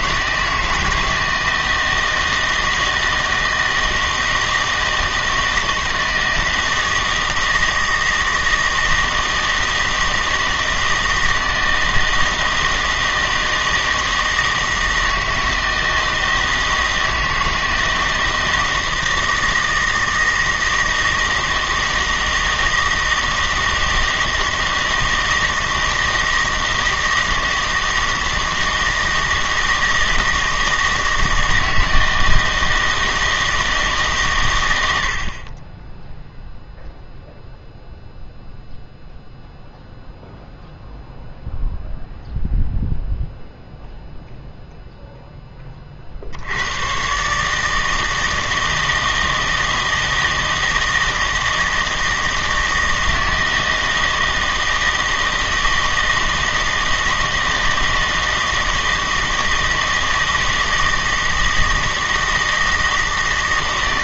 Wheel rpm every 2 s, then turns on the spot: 160, 160, 160, 160, 160, 160, 160, 160, 160, 160, 160, 160, 160, 160, 160, 160, 160, 80, 0, 0, 0, 0, 0, 100, 160, 160, 160, 160, 160, 160, 160, 160.
none